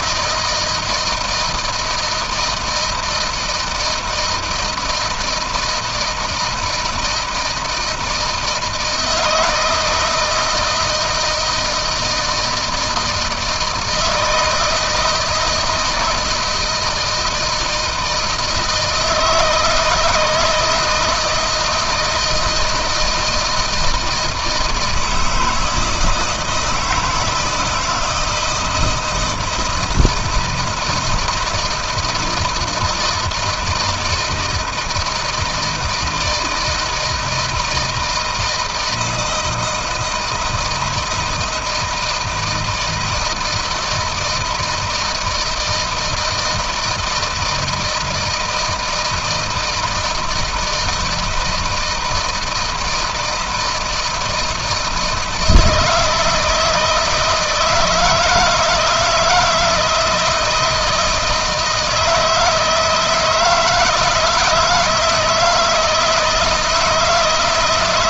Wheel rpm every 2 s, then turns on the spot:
160, 160, 160, 160, 160, 160, 160, 160, 160, 160, 160, 160, 160, 170, 170, 160, 160, 160, 160, 160, 170, 160, 160, 160, 160, 160, 160, 160, 160, 160, 160, 160, 160, 160.
none